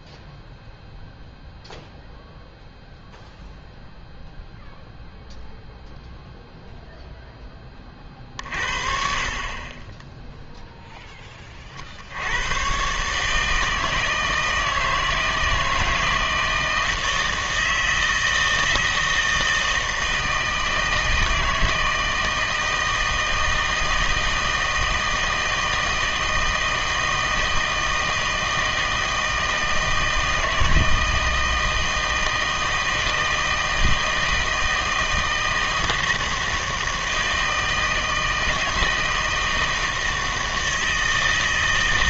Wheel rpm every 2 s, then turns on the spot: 0, 0, 0, 0, 50, 0, 120, 160, 160, 160, 160, 160, 160, 160, 160, 160, 160, 160, 160, 160, 160.
none